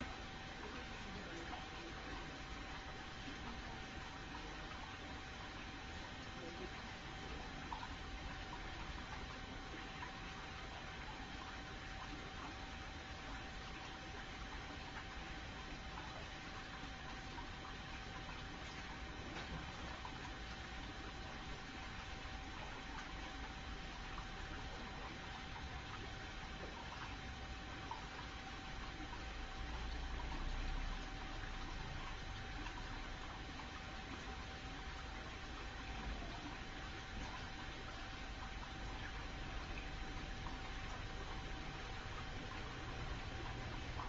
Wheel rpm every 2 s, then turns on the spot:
0, 0, 0, 0, 0, 0, 0, 0, 0, 0, 0, 0, 0, 0, 0, 0, 0, 0, 0, 0, 0, 0.
none